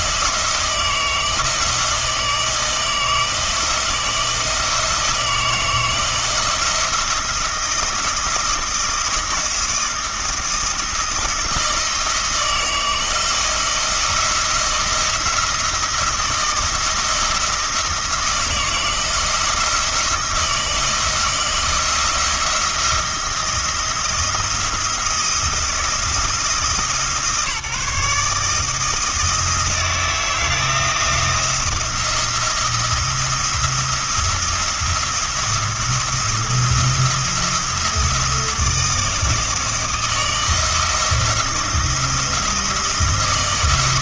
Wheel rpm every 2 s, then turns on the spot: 160, 160, 160, 170, 170, 160, 160, 170, 170, 170, 160, 170, 170, 160, 160, 170, 170, 170, 170, 160, 170, 170.
none